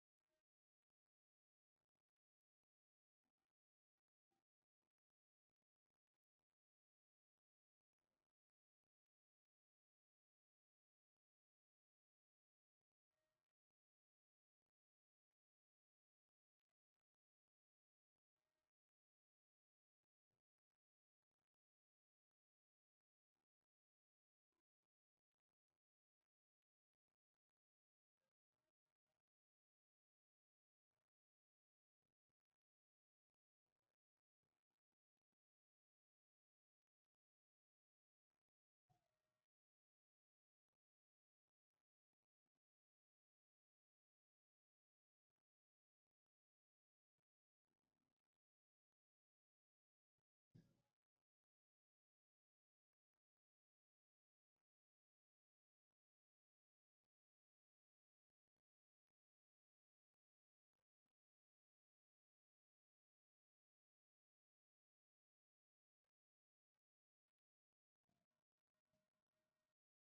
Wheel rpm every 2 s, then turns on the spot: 0, 0, 0, 0, 0, 0, 0, 0, 0, 0, 0, 0, 0, 0, 0, 0, 0, 0, 0, 0, 0, 0, 0, 0, 0, 0, 0, 0, 0, 0, 0, 0, 0, 0, 0.
none